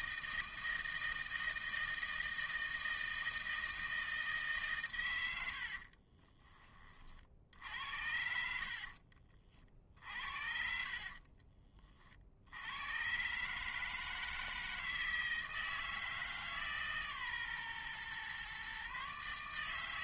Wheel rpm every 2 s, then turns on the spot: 160, 160, 150, 20, 60, 60, 80, 160, 150, 130.
8-12